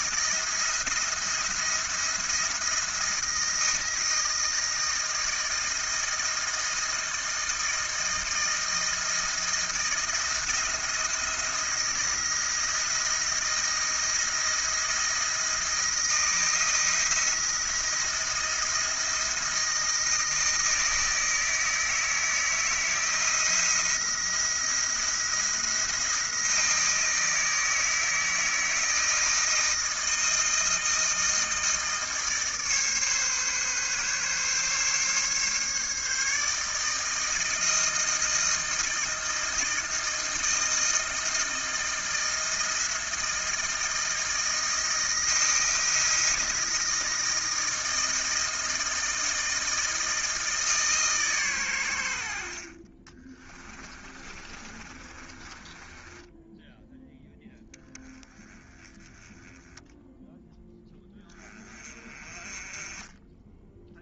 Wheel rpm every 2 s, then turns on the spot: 170, 170, 160, 160, 160, 170, 170, 170, 160, 170, 160, 170, 170, 160, 160, 160, 140, 140, 160, 160, 160, 160, 160, 160, 160, 140, 30, 30, 0, 10, 10, 20.
52-56